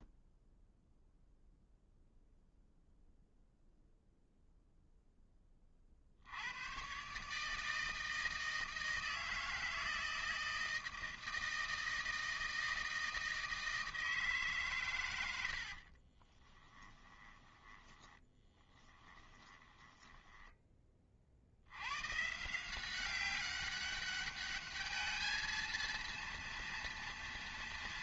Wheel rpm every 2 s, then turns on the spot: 0, 0, 0, 110, 160, 160, 160, 130, 20, 10, 10, 180, 210, 230.
16-20